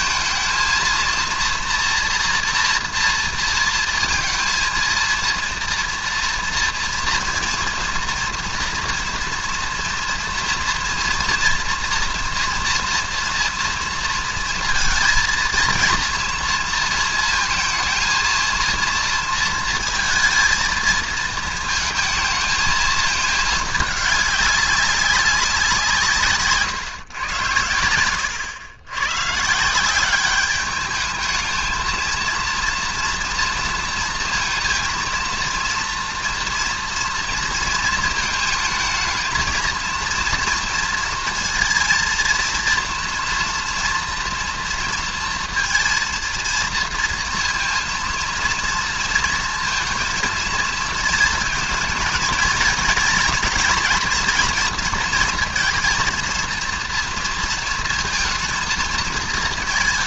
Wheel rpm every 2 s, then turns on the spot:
230, 240, 230, 230, 240, 230, 240, 230, 230, 230, 220, 220, 200, 130, 100, 200, 230, 230, 230, 220, 230, 230, 230, 230, 230, 230, 230, 240, 230, 230.
none